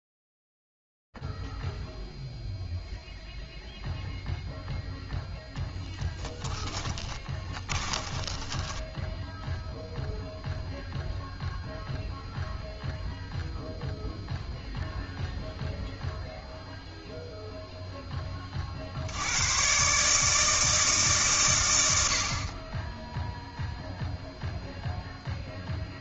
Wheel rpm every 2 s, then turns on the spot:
0, 0, 0, 10, 10, 0, 0, 0, 0, 40, 160, 20, 0.
6-10